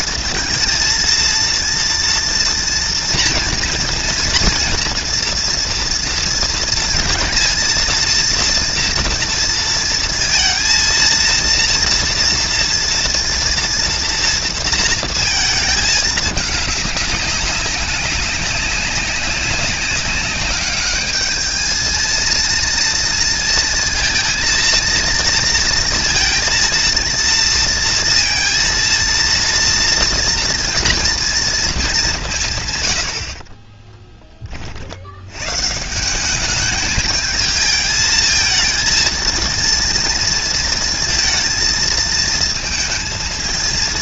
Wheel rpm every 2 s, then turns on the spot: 230, 230, 240, 230, 230, 230, 240, 230, 210, 200, 200, 230, 230, 230, 230, 230, 140, 20, 200, 220, 230, 230.
none